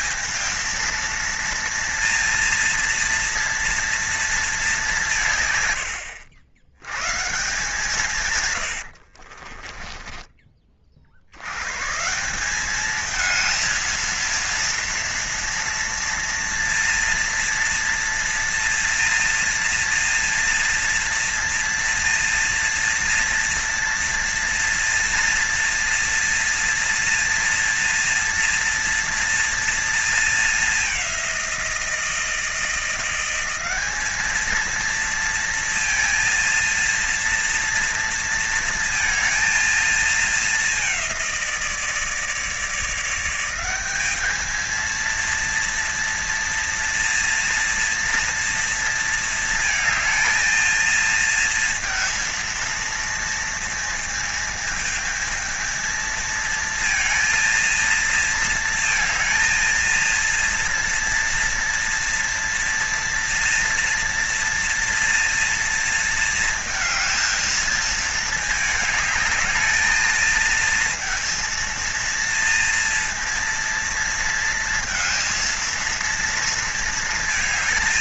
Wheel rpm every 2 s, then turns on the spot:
230, 240, 210, 110, 100, 30, 200, 230, 230, 240, 230, 230, 230, 240, 230, 210, 170, 220, 230, 230, 200, 160, 220, 230, 230, 230, 230, 220, 230, 230, 230, 230, 230, 230, 220, 230, 230, 230, 230.
8-10